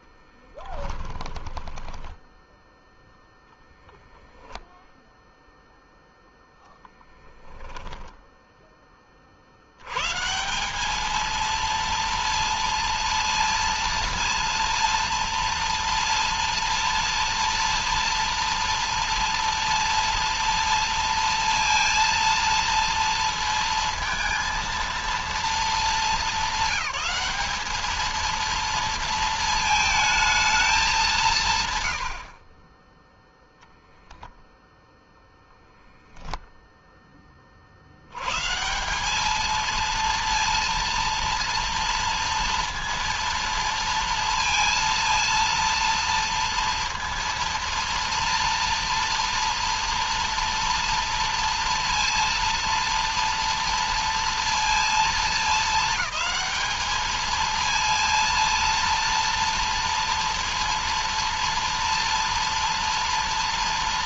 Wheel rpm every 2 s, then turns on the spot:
10, 0, 0, 0, 30, 210, 230, 230, 230, 230, 230, 230, 230, 210, 230, 200, 20, 0, 0, 150, 230, 230, 230, 230, 230, 230, 230, 230, 210, 230, 230, 230.
0-2